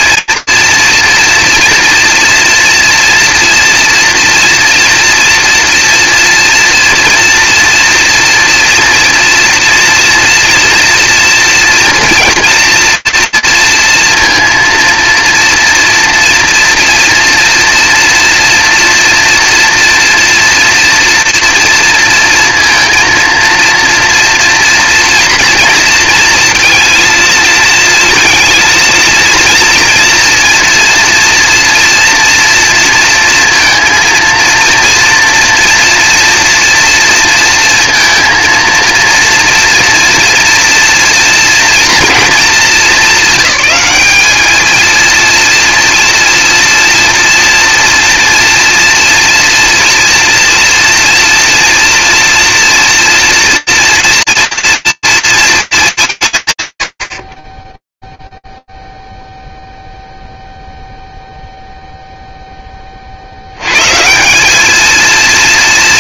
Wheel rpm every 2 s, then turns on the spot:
230, 230, 230, 230, 230, 230, 240, 230, 230, 230, 230, 230, 230, 230, 220, 240, 230, 230, 230, 230, 230, 230, 200, 230, 230, 230, 230, 230, 200, 0, 0, 0, 190.
none